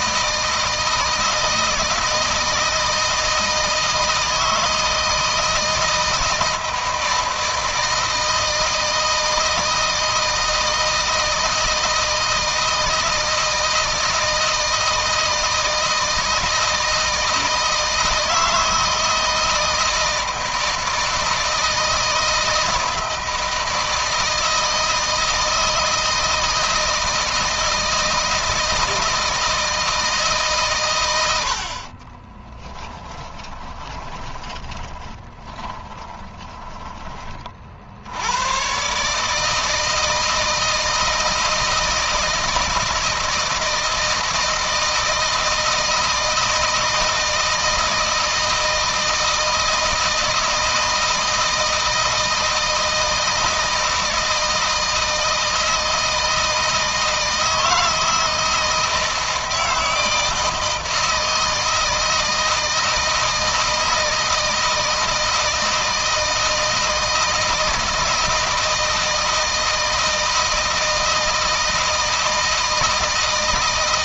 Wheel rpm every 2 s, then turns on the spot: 160, 160, 160, 160, 160, 160, 160, 160, 160, 160, 160, 160, 160, 160, 160, 110, 20, 20, 20, 140, 160, 160, 160, 160, 160, 160, 160, 160, 160, 160, 160, 160, 160, 160, 160, 160, 160.
32-36